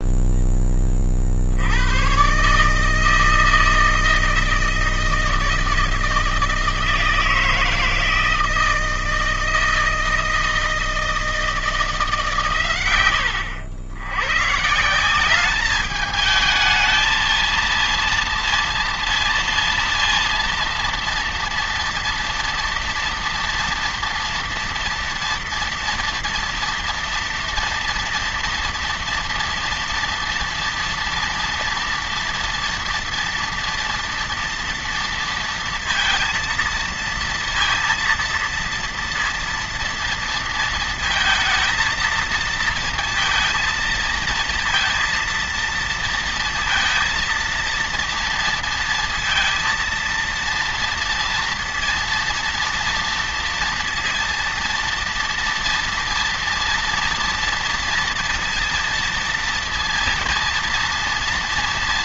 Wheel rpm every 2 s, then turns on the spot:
20, 150, 160, 160, 160, 160, 120, 160, 220, 230, 230, 240, 230, 240, 240, 230, 230, 230, 230, 230, 230, 230, 230, 230, 230, 230, 230, 230, 230, 230, 230.
none